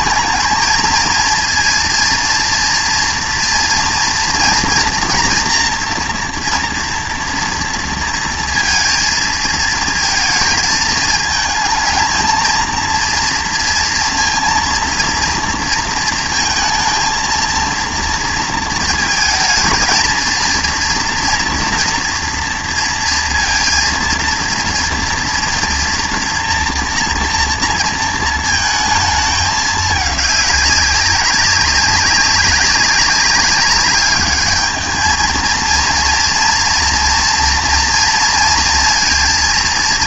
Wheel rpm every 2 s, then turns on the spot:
230, 230, 230, 230, 230, 220, 220, 230, 230, 230, 230, 230, 230, 240, 220, 210, 190, 210, 230, 230.
none